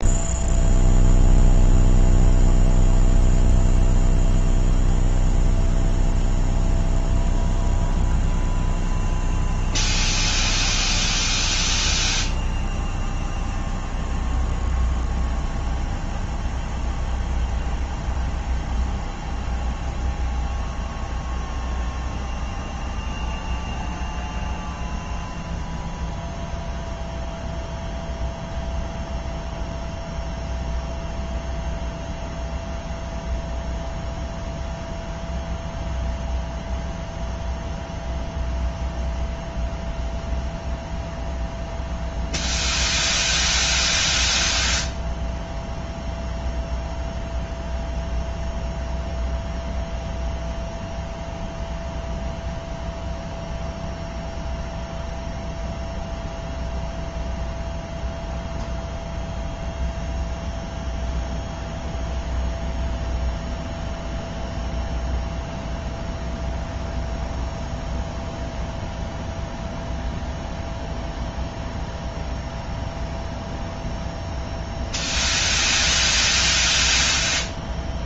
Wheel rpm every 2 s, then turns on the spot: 0, 0, 0, 0, 0, 0, 0, 0, 0, 0, 0, 0, 0, 0, 0, 0, 0, 0, 0, 0, 0, 0, 0, 0, 0, 0, 0, 0, 0, 0, 0, 0, 0, 0, 0, 0, 0, 0, 0.
none